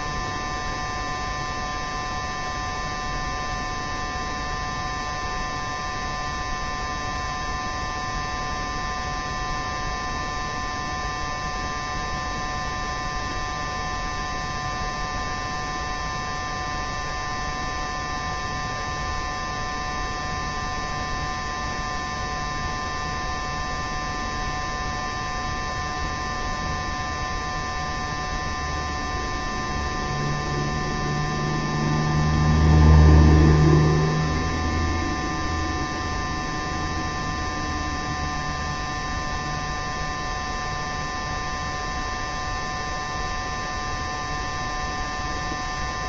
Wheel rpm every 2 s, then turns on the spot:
0, 0, 0, 0, 0, 0, 0, 0, 0, 0, 0, 0, 0, 0, 0, 0, 0, 0, 0, 0, 0, 0, 0.
none